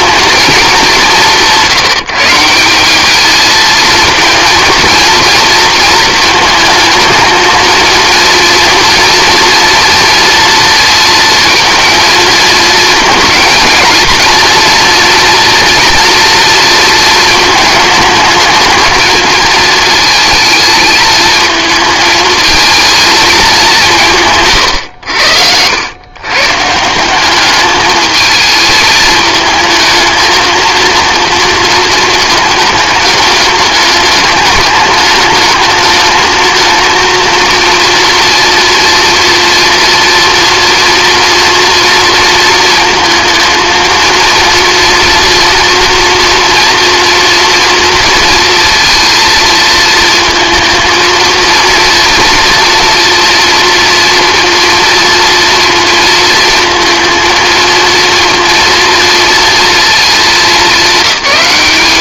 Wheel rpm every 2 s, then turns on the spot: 190, 200, 230, 220, 230, 230, 230, 230, 230, 220, 220, 220, 90, 170, 220, 230, 210, 210, 230, 230, 230, 220, 230, 230, 230, 230, 230, 240, 230, 230, 210.
24-26